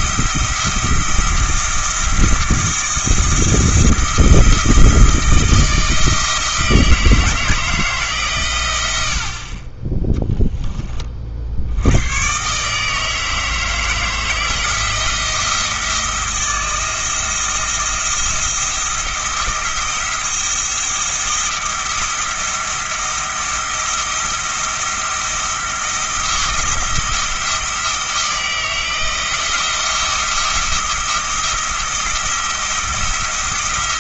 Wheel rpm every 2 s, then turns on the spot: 170, 170, 160, 160, 100, 20, 140, 160, 170, 170, 170, 170, 170, 170, 170, 170, 170.
none